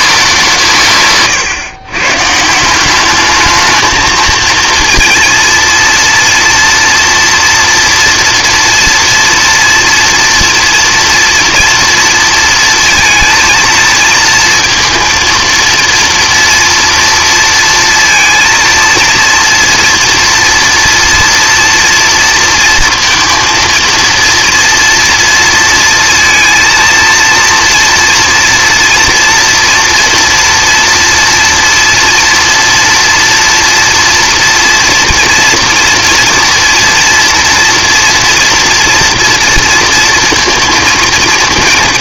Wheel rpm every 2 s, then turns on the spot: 150, 180, 230, 230, 230, 240, 230, 230, 230, 230, 240, 230, 230, 230, 230, 230, 230, 230, 230, 230, 230.
none